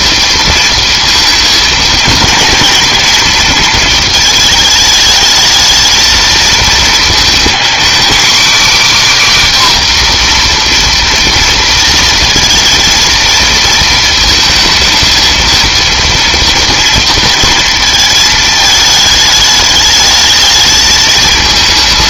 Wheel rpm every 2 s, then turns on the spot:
230, 230, 220, 230, 280, 240, 230, 230, 230, 220, 210.
none